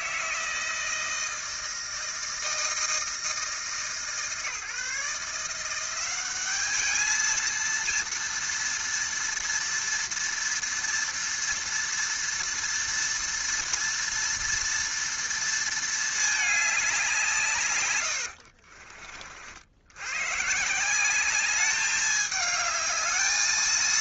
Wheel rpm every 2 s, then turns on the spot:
160, 160, 150, 200, 230, 230, 230, 230, 210, 50, 150, 210.
18-20